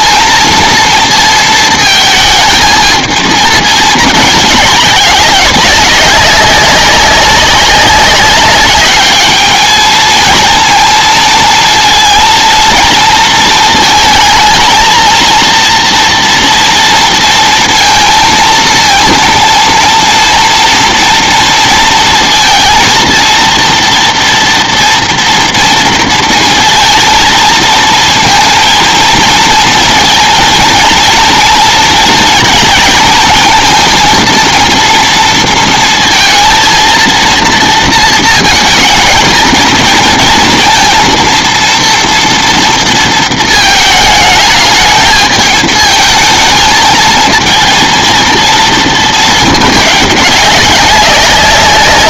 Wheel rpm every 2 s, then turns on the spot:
230, 220, 200, 200, 200, 230, 230, 230, 230, 230, 230, 230, 230, 230, 230, 230, 230, 230, 230, 220, 230, 230, 220, 220, 230, 190.
none